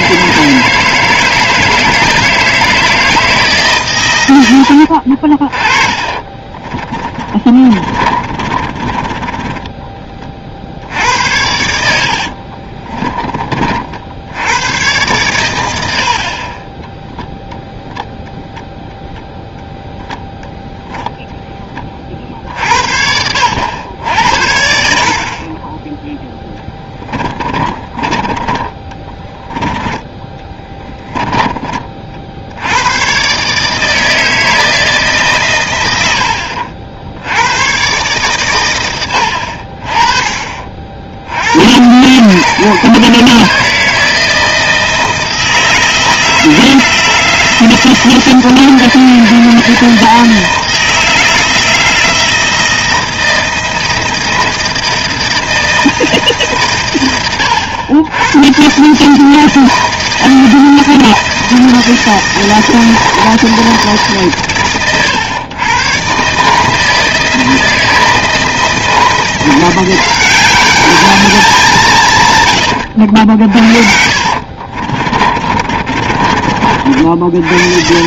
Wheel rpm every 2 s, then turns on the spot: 160, 160, 90, 30, 20, 60, 30, 100, 30, 0, 0, 60, 60, 10, 20, 20, 80, 160, 70, 120, 40, 140, 160, 160, 160, 160, 160, 170, 130, 120, 160, 160, 130, 150, 160, 200, 100, 50, 50.
4-10 12-14 16-18 26-28 30-32 74-76